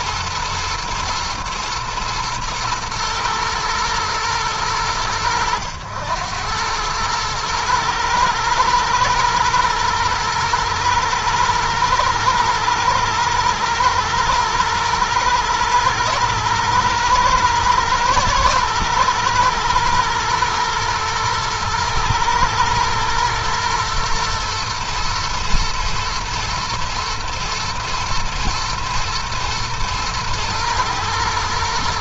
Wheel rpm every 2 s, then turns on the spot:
120, 110, 100, 110, 120, 120, 110, 120, 110, 120, 110, 110, 110, 110, 110, 110.
none